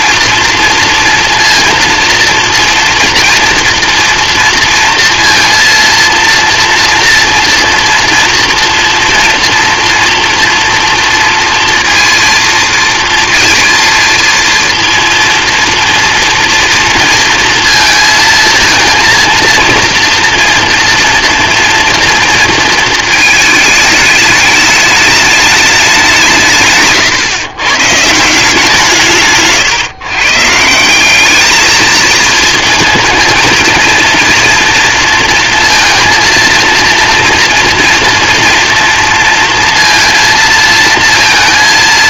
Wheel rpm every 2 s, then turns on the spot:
230, 230, 230, 230, 230, 230, 230, 230, 230, 230, 240, 230, 210, 140, 170, 160, 230, 230, 230, 230, 220.
none